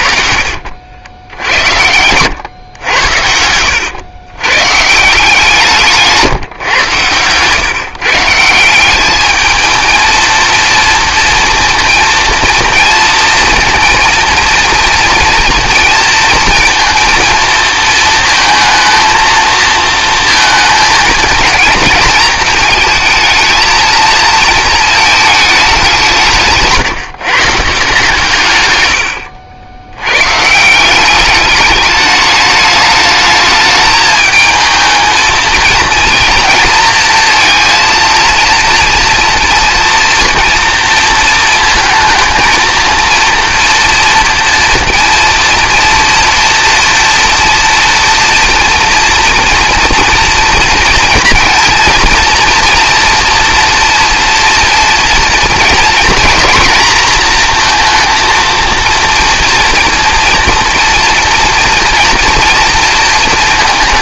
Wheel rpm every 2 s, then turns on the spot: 60, 110, 120, 140, 170, 230, 230, 230, 230, 230, 220, 220, 230, 150, 130, 140, 210, 220, 230, 230, 230, 220, 230, 230, 230, 230, 230, 230, 230, 230, 230, 230.
0-2